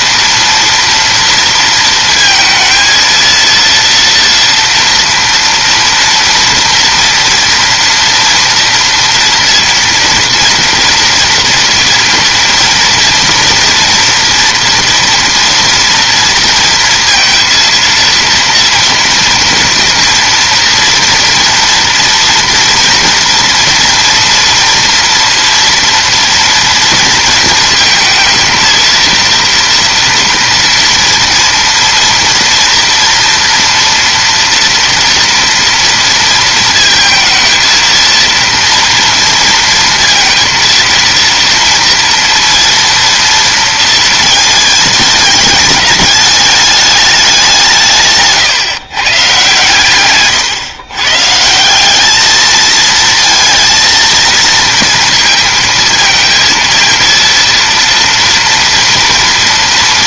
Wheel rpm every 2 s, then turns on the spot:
230, 230, 230, 230, 230, 230, 230, 230, 230, 230, 230, 230, 230, 230, 230, 230, 230, 230, 220, 230, 230, 230, 220, 210, 140, 120, 220, 220, 230, 230.
none